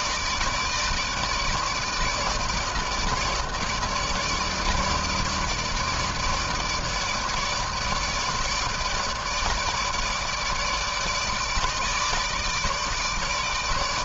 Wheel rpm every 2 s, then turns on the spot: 150, 150, 160, 160, 150, 150, 150.
none